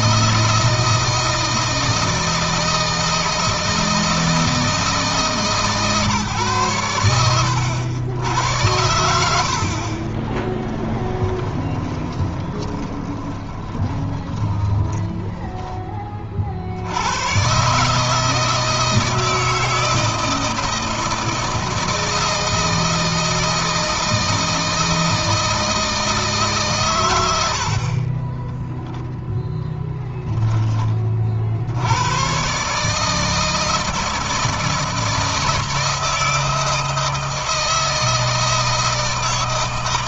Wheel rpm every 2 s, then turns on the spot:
160, 160, 150, 100, 70, 20, 20, 10, 80, 160, 160, 160, 160, 120, 0, 30, 150, 160, 160, 160.
8-16